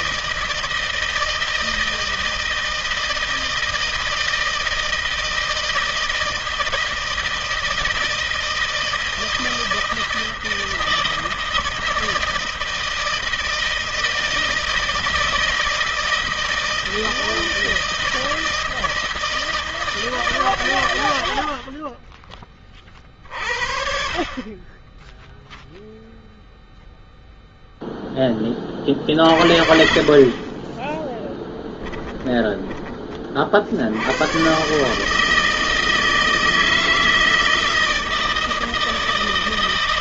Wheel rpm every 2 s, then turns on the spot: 160, 160, 160, 160, 160, 160, 160, 160, 160, 160, 100, 30, 10, 0, 40, 20, 20, 140, 160, 160.
30-32